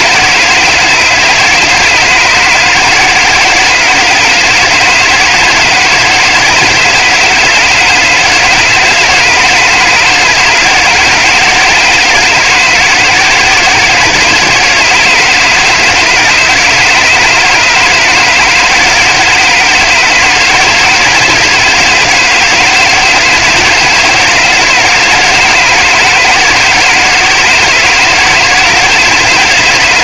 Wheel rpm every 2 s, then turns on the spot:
160, 160, 160, 170, 160, 160, 160, 160, 160, 160, 160, 160, 160, 160, 160.
none